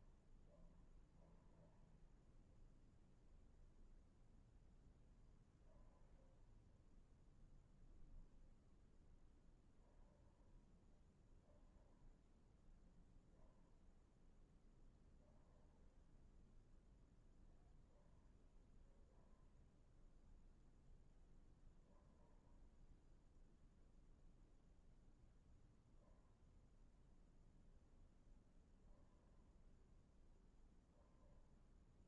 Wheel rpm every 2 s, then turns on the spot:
0, 0, 0, 0, 0, 0, 0, 0, 0, 0, 0, 0, 0, 0, 0, 0.
none